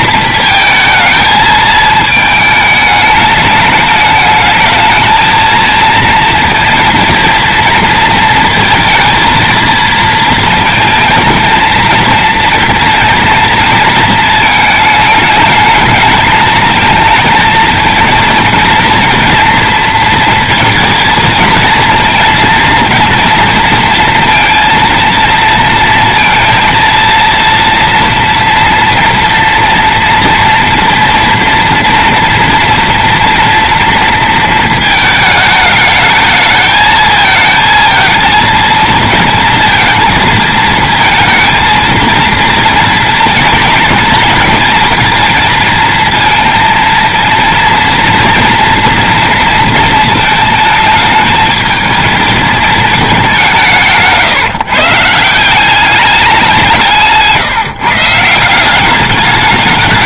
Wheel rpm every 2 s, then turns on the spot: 220, 210, 220, 230, 230, 220, 230, 220, 230, 240, 230, 230, 230, 230, 230, 230, 230, 220, 220, 230, 220, 230, 230, 230, 230, 220, 210, 160, 160, 190.
56-58